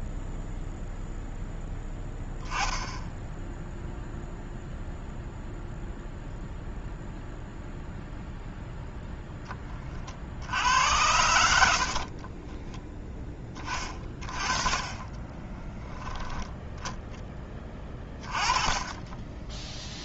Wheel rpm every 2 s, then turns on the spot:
0, 10, 0, 0, 0, 80, 20, 20, 0, 20.
12-14